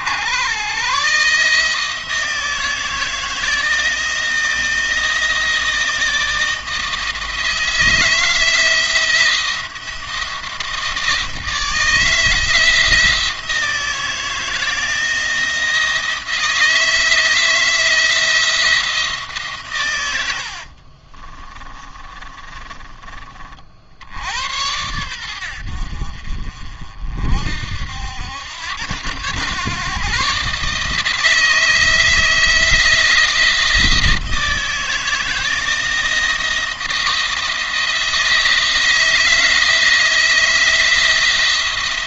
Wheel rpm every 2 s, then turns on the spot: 120, 160, 160, 160, 160, 170, 160, 160, 160, 170, 60, 30, 80, 50, 90, 140, 170, 160, 170, 160, 170.
20-24